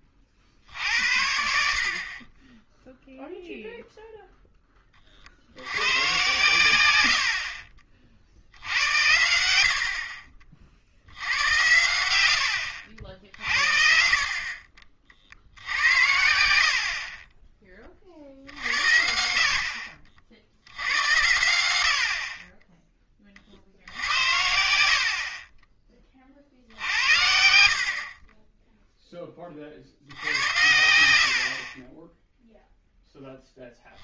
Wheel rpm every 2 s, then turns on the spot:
40, 10, 10, 110, 70, 50, 70, 40, 70, 60, 80, 20, 80, 60, 20, 80, 0.
none